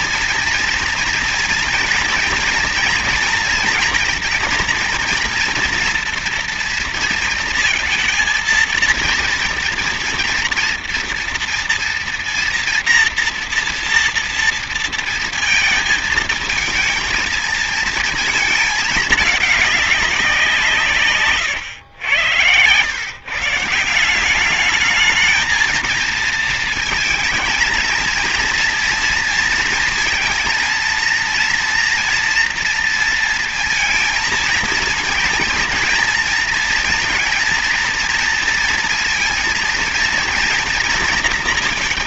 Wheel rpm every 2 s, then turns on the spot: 230, 230, 230, 240, 230, 240, 240, 230, 230, 220, 180, 120, 200, 220, 230, 230, 230, 230, 230, 240, 230.
none